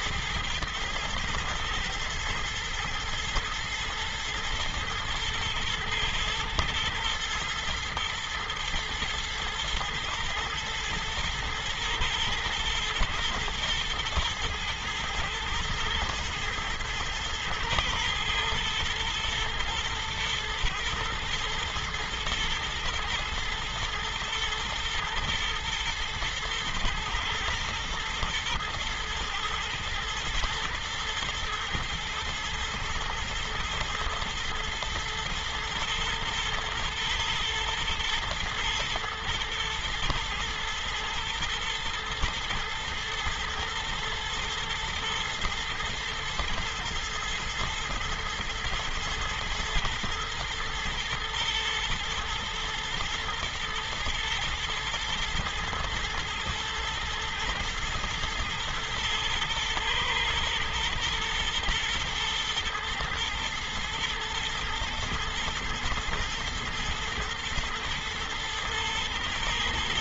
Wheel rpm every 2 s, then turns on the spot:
110, 110, 120, 110, 120, 110, 120, 120, 110, 120, 110, 110, 120, 120, 110, 120, 120, 110, 110, 110, 110, 120, 110, 110, 110, 110, 120, 110, 110, 110, 110, 120, 110, 110, 120.
none